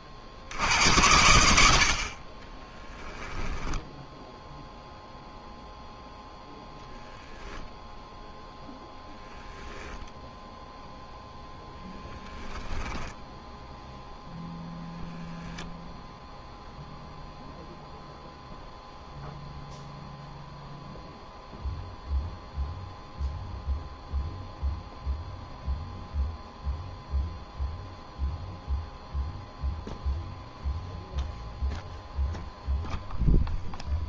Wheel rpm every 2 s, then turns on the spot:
50, 20, 0, 0, 0, 0, 10, 0, 0, 0, 0, 0, 0, 0, 0, 0, 0.
2-4 12-14